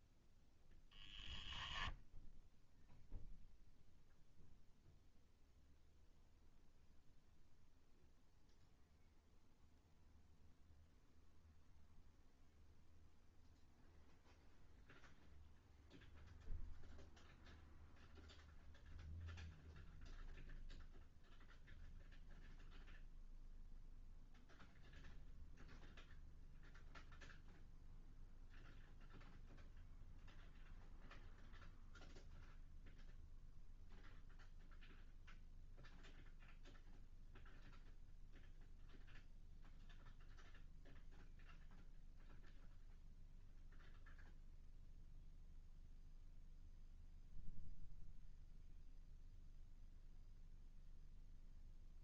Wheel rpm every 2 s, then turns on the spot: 0, 0, 0, 0, 0, 0, 0, 0, 0, 0, 0, 0, 0, 0, 0, 0, 0, 0, 0, 0, 0, 0, 0, 0, 0, 0.
none